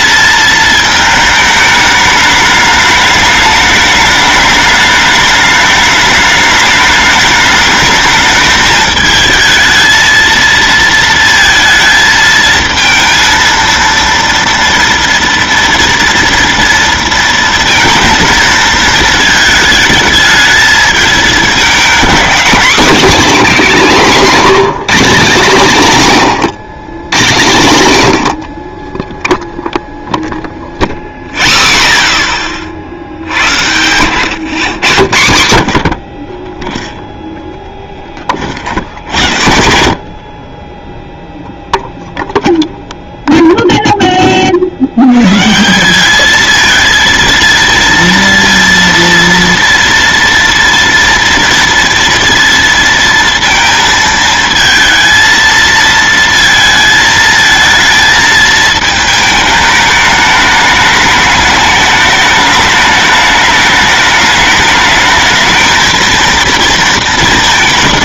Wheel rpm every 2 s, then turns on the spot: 220, 210, 210, 210, 220, 230, 230, 230, 230, 220, 220, 240, 220, 140, 50, 0, 40, 120, 10, 50, 30, 0, 60, 220, 230, 230, 230, 220, 220, 220, 210, 210, 210, 230.
38-40